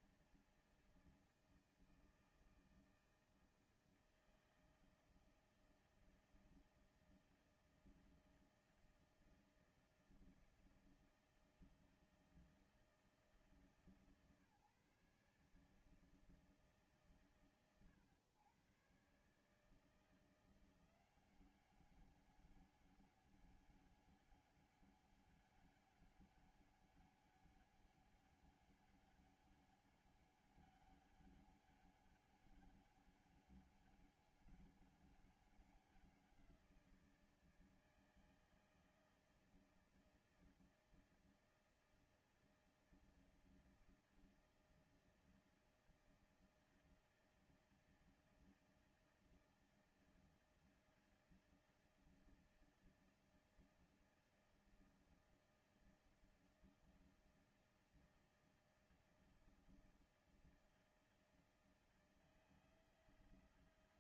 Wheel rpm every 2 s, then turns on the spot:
160, 160, 160, 160, 160, 160, 160, 150, 150, 120, 170, 200, 200, 200, 200, 200, 200, 200, 170, 160, 160, 160, 160, 160, 160, 160, 160, 160, 160, 160, 160, 160.
none